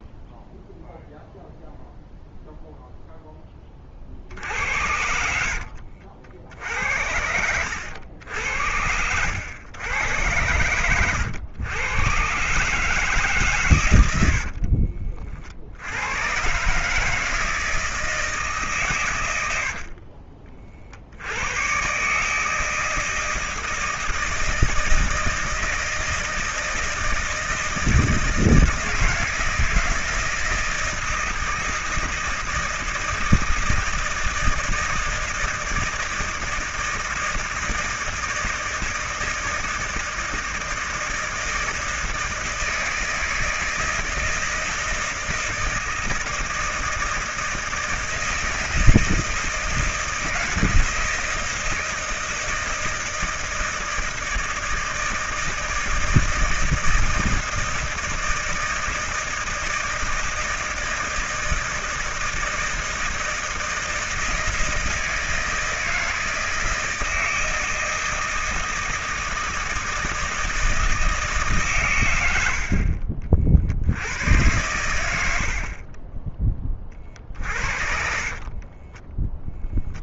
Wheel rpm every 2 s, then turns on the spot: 0, 0, 60, 70, 80, 100, 140, 70, 140, 140, 30, 150, 160, 160, 160, 160, 160, 160, 160, 160, 160, 160, 160, 160, 160, 170, 160, 160, 160, 160, 160, 160, 160, 160, 160, 160, 70, 110, 20, 30.
4-6 8-10 14-16 72-74 78-80